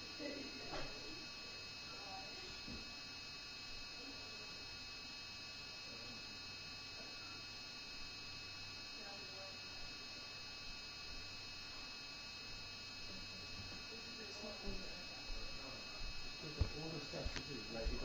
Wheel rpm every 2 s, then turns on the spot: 0, 0, 0, 0, 0, 0, 0, 0, 0.
none